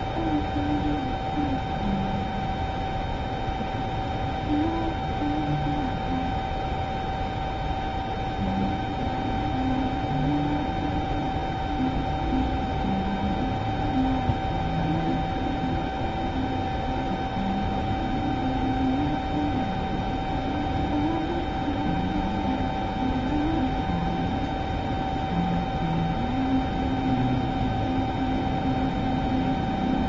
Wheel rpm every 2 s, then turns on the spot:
0, 0, 0, 0, 0, 0, 0, 0, 0, 0, 0, 0, 0, 0, 0.
none